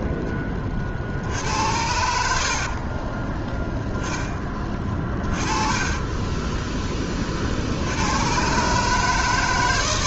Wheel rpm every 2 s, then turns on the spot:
40, 40, 20, 20, 130.
2-4